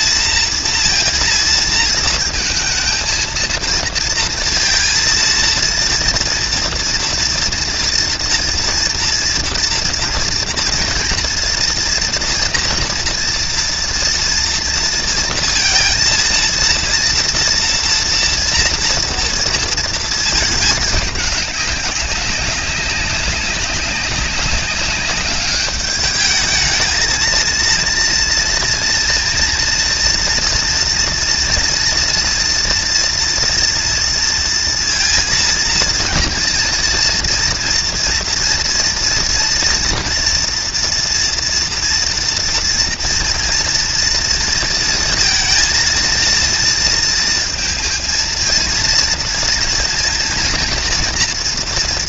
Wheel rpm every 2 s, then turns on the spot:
230, 220, 230, 240, 230, 230, 230, 230, 230, 230, 220, 200, 200, 220, 230, 240, 240, 230, 230, 230, 230, 230, 230, 230, 230, 230.
none